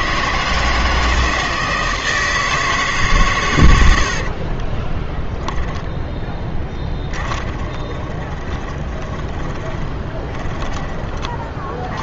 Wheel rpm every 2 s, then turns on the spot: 160, 160, 40, 10, 20, 20.
4-12